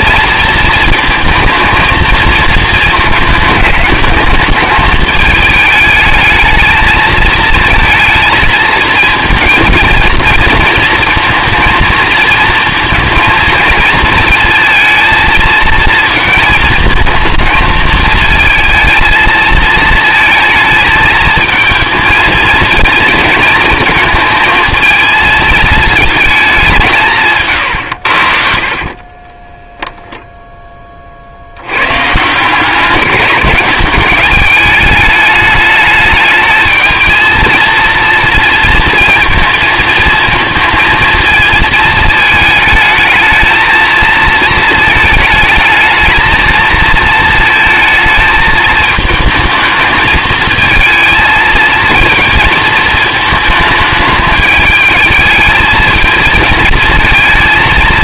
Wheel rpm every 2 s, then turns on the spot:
230, 230, 220, 220, 230, 230, 230, 230, 220, 220, 220, 220, 220, 200, 50, 20, 170, 210, 220, 230, 230, 220, 220, 230, 220, 220, 230, 220, 230.
none